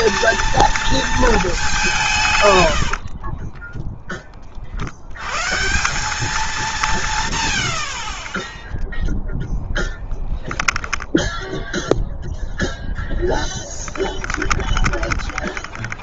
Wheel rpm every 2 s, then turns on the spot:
230, 60, 100, 160, 0, 10, 10, 20.
2-4 10-12 14-16